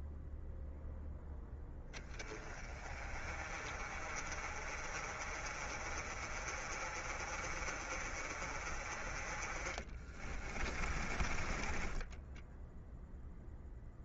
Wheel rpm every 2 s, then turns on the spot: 0, 30, 40, 40, 30, 20, 0.
10-12